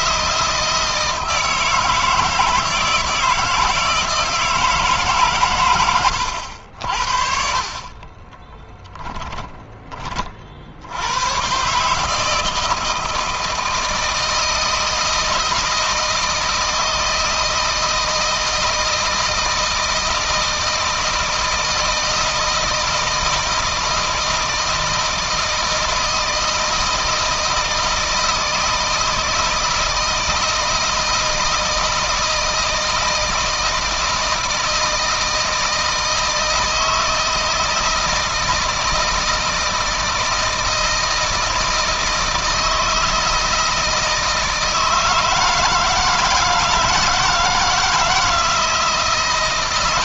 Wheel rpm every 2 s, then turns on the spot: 160, 160, 150, 60, 10, 90, 160, 160, 160, 160, 160, 160, 160, 160, 160, 160, 160, 160, 160, 160, 160, 160, 160, 160, 160.
8-10